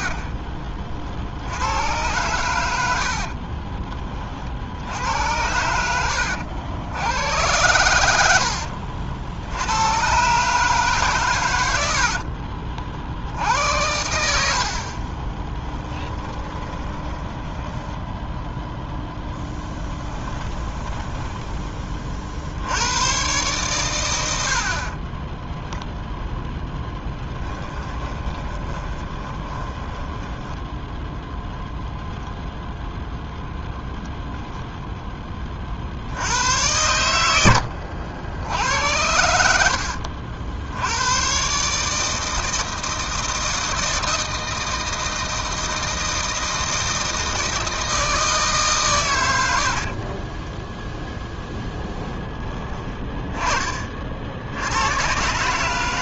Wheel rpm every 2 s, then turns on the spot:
50, 90, 60, 80, 80, 150, 50, 50, 20, 0, 10, 90, 50, 10, 20, 10, 0, 0, 110, 80, 90, 160, 160, 160, 130, 0, 20, 100.
16-18 20-22 26-30